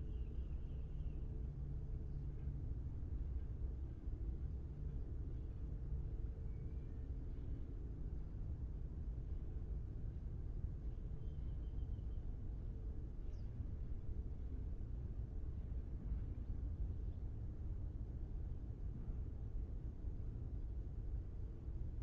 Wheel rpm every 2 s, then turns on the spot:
0, 0, 0, 0, 0, 0, 0, 0, 0, 0, 0.
none